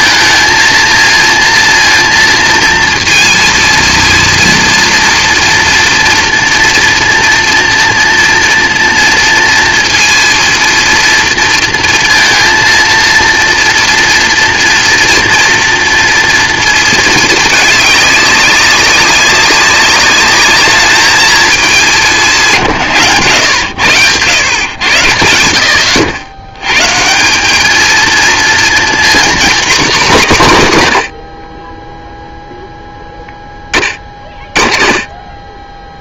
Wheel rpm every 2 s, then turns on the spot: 230, 230, 230, 230, 230, 230, 230, 230, 230, 200, 210, 150, 90, 120, 240, 170, 0, 20.
none